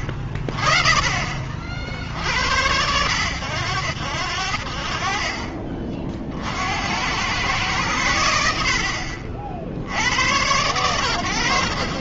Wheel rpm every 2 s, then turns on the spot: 20, 70, 60, 70, 80, 100.
none